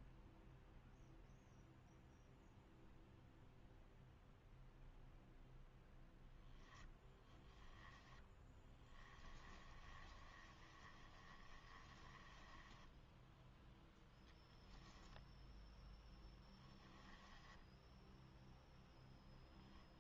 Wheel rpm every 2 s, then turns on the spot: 0, 0, 0, 10, 10, 20, 10, 10, 10, 0.
6-14 16-18